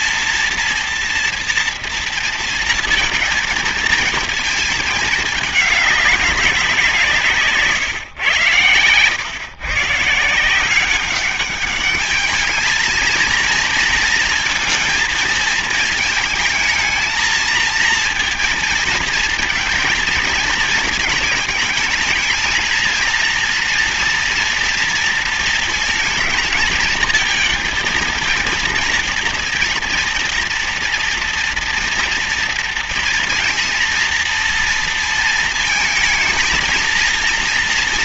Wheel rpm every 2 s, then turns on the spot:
240, 230, 220, 180, 100, 180, 220, 230, 220, 230, 220, 220, 230, 220, 230, 230, 230, 230, 230.
none